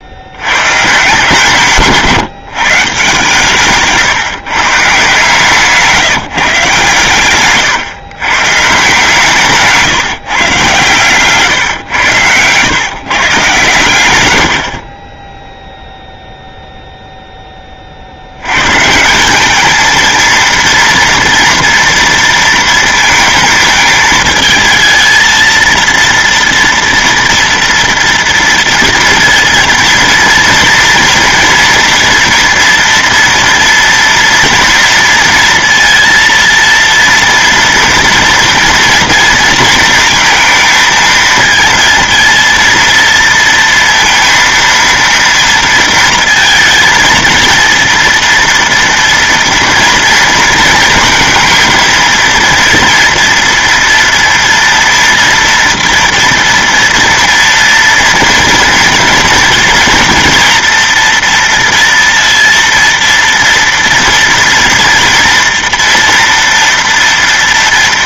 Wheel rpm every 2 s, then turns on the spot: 100, 160, 140, 150, 140, 130, 110, 90, 0, 110, 230, 230, 220, 230, 230, 230, 230, 230, 230, 230, 230, 230, 230, 230, 230, 230, 230, 230, 230, 230, 230, 230, 230, 240.
none